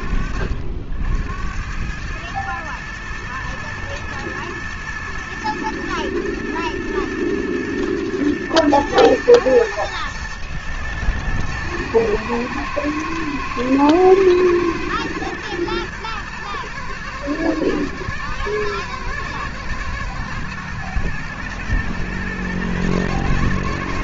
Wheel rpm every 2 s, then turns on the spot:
60, 120, 120, 120, 110, 110, 110, 110, 110, 110, 110, 110.
none